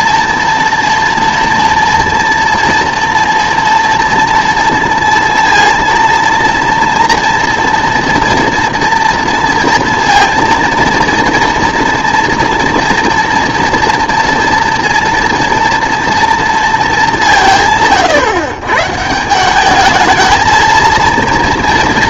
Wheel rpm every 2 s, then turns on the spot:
230, 230, 230, 230, 240, 230, 230, 230, 230, 130, 230.
none